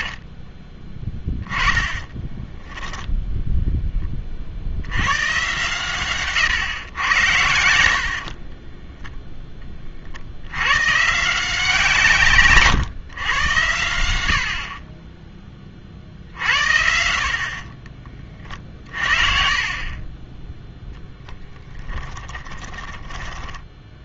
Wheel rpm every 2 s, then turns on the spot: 50, 10, 50, 140, 30, 100, 130, 50, 70, 50, 10, 20.
0-4 8-10 18-24